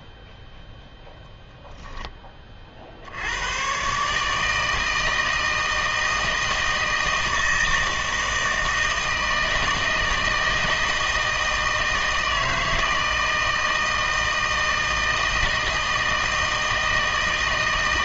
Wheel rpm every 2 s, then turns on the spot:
0, 30, 160, 160, 160, 160, 160, 160, 160.
none